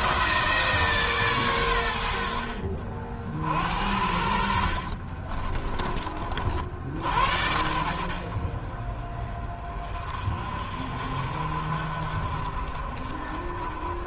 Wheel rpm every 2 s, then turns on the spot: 150, 50, 50, 60, 40, 50, 40.
4-6